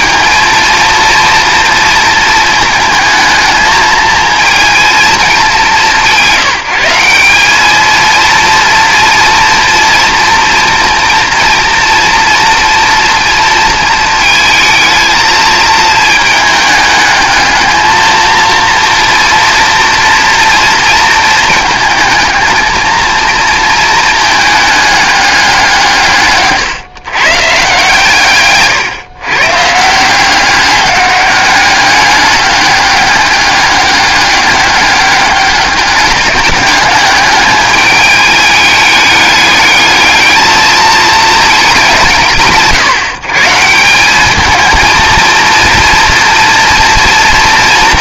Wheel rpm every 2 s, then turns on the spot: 230, 220, 230, 180, 230, 230, 230, 220, 210, 230, 230, 220, 210, 140, 140, 190, 200, 200, 200, 210, 220, 150, 220, 230.
none